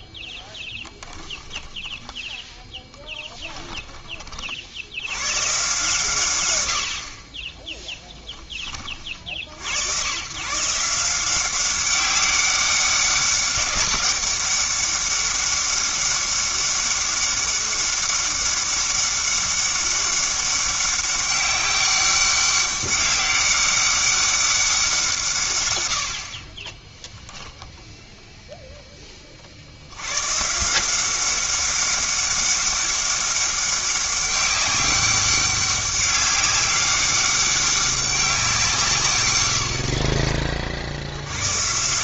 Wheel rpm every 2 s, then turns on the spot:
10, 10, 40, 100, 30, 150, 200, 200, 200, 200, 200, 200, 190, 30, 0, 150, 200, 200, 200, 180, 40.
0-2